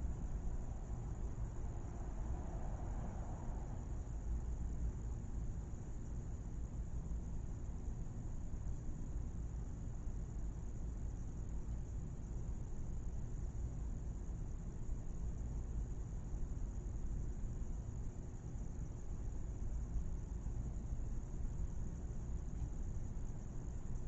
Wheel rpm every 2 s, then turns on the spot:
0, 0, 0, 0, 0, 0, 0, 0, 0, 0, 0, 0.
none